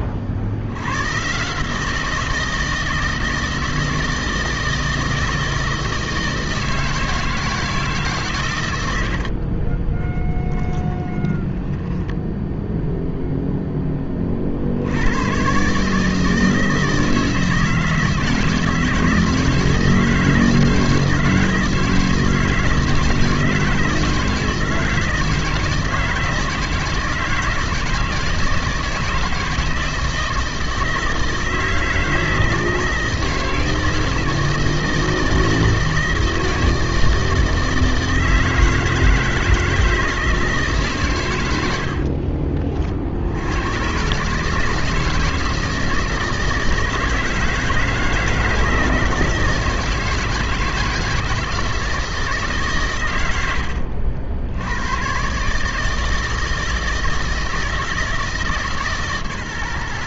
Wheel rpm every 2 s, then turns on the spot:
60, 160, 160, 160, 110, 20, 0, 50, 160, 160, 160, 160, 160, 160, 160, 160, 160, 160, 160, 160, 150, 40, 150, 160, 160, 160, 140, 80, 160, 160.
10-12